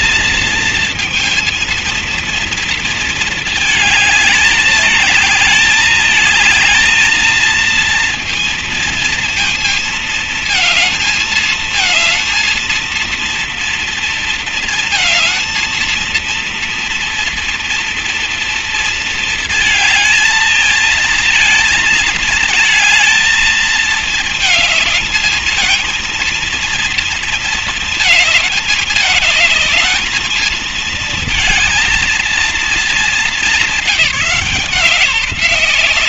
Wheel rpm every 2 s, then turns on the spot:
230, 230, 210, 230, 230, 230, 230, 230, 230, 220, 230, 220, 220, 230, 220, 230, 210, 180.
none